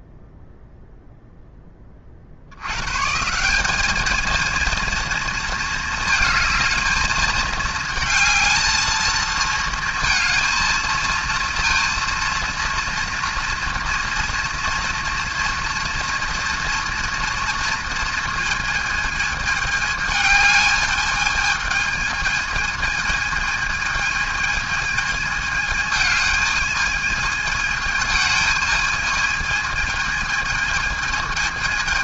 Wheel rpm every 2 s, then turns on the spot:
0, 110, 230, 220, 220, 230, 230, 230, 230, 220, 220, 220, 220, 220, 220, 220.
none